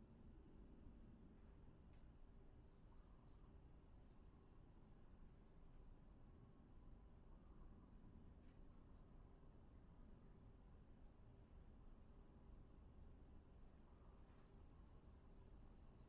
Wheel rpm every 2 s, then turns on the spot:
0, 0, 0, 0, 0, 0, 0, 0.
none